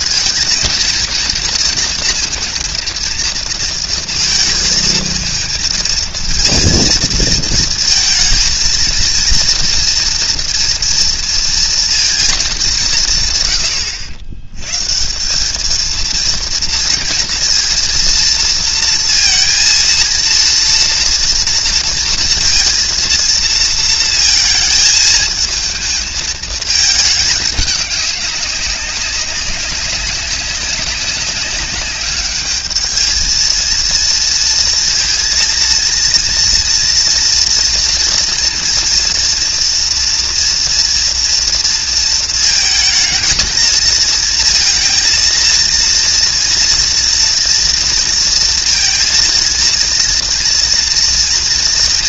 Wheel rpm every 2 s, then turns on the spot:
230, 230, 230, 230, 230, 230, 210, 110, 230, 230, 230, 230, 220, 220, 200, 190, 210, 230, 230, 230, 240, 220, 230, 230, 230, 230.
none